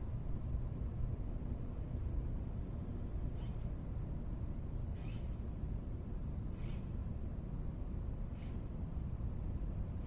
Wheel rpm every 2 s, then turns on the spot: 0, 0, 0, 0, 0.
none